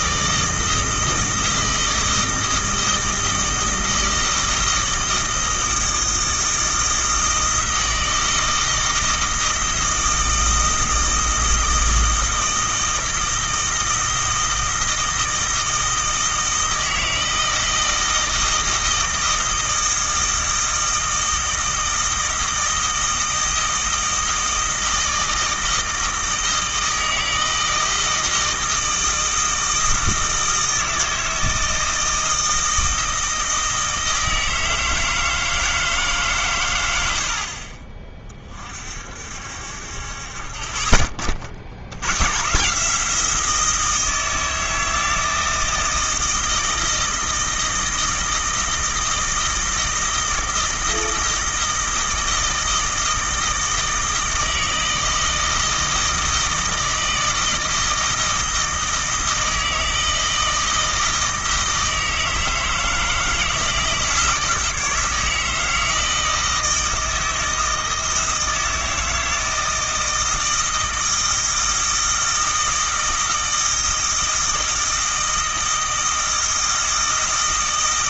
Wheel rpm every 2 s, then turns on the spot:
160, 160, 160, 160, 160, 160, 160, 160, 160, 160, 160, 160, 160, 160, 160, 160, 160, 160, 110, 40, 30, 150, 160, 160, 160, 160, 160, 160, 160, 160, 160, 160, 160, 160, 160, 160, 160, 160, 160.
none